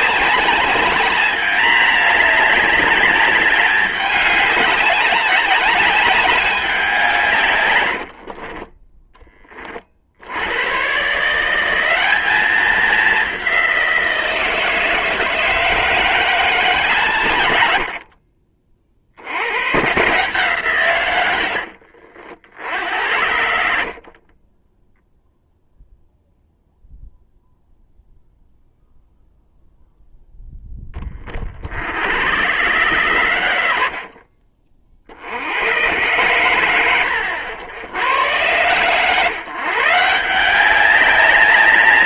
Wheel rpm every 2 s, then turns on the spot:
210, 200, 200, 170, 20, 140, 200, 160, 150, 60, 130, 70, 0, 0, 0, 20, 100, 50, 100, 120, 190.
none